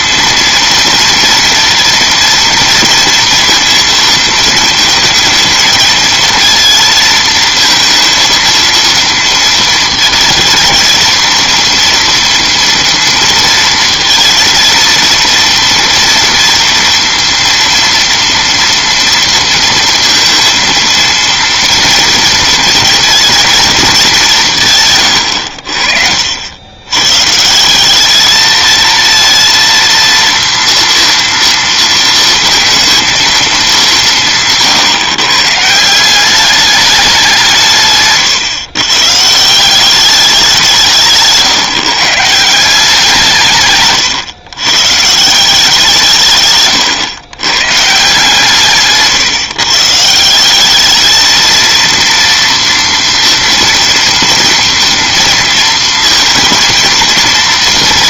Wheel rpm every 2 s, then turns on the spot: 230, 230, 230, 230, 230, 230, 230, 230, 230, 230, 220, 230, 140, 100, 220, 230, 230, 140, 200, 130, 170, 170, 130, 120, 140, 200, 230, 230, 230.
none